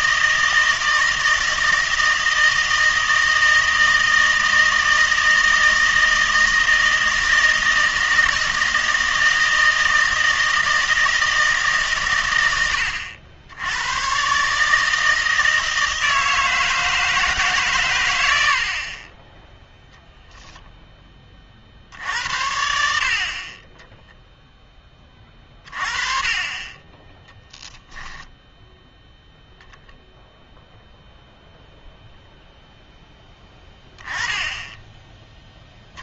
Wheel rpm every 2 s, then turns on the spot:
160, 160, 160, 160, 160, 160, 90, 150, 160, 60, 0, 70, 10, 20, 0, 0, 0, 10.
none